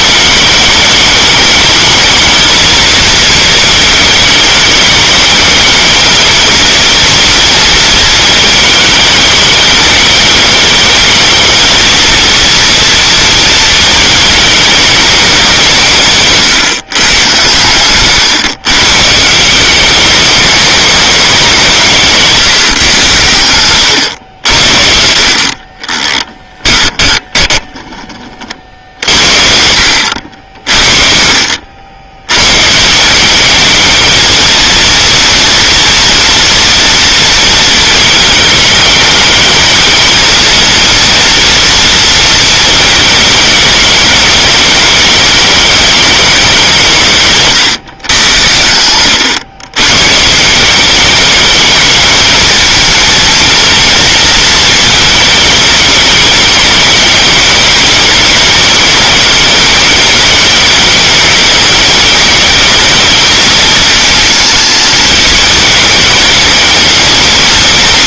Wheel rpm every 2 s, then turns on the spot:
200, 220, 210, 230, 220, 220, 230, 220, 140, 130, 210, 160, 80, 10, 40, 60, 120, 220, 230, 210, 220, 220, 210, 200, 100, 160, 220, 230, 210, 210, 210, 220, 220, 220.
26-28